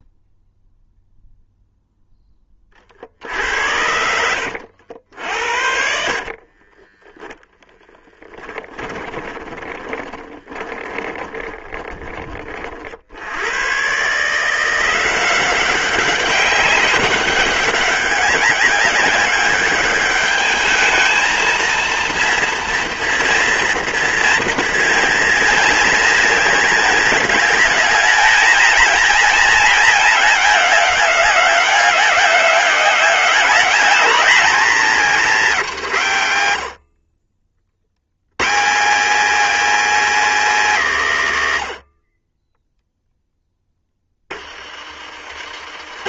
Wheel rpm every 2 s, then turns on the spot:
0, 40, 70, 20, 10, 10, 40, 170, 190, 190, 220, 230, 230, 220, 220, 200, 190, 230, 70, 190, 200, 10, 30.
6-12